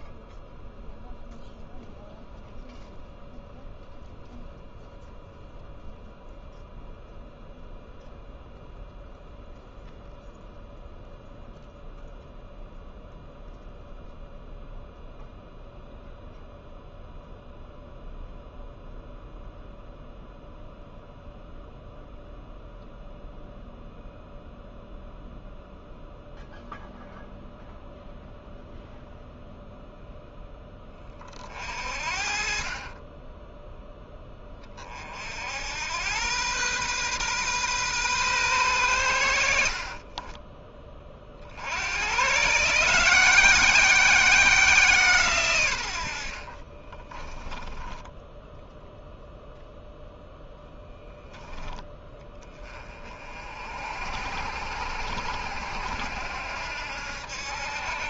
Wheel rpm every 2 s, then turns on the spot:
0, 0, 0, 0, 0, 0, 0, 0, 0, 0, 0, 0, 0, 0, 0, 20, 40, 30, 120, 120, 20, 150, 170, 50, 10, 0, 30, 80, 80.
46-48